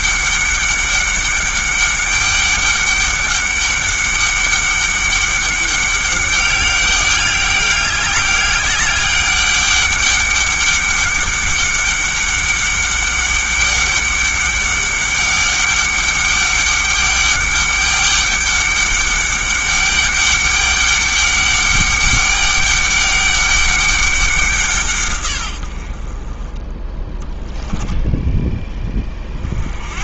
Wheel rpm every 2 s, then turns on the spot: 200, 200, 200, 200, 200, 200, 200, 200, 200, 200, 200, 200, 170, 20, 20.
none